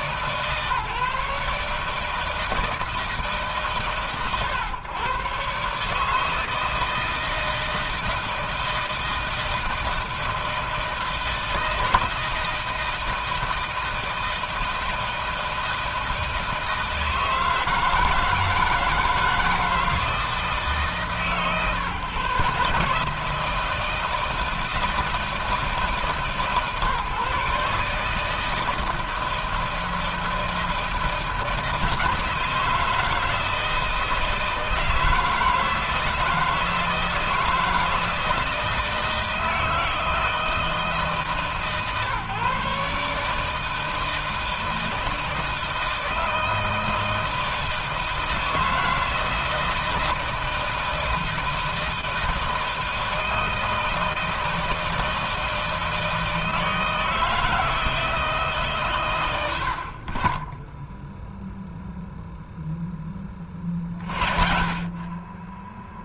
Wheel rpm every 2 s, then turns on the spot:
150, 160, 130, 160, 160, 160, 160, 160, 160, 160, 150, 140, 160, 150, 160, 160, 160, 160, 160, 160, 160, 140, 160, 160, 160, 160, 160, 160, 160, 140, 10, 10, 40.
60-62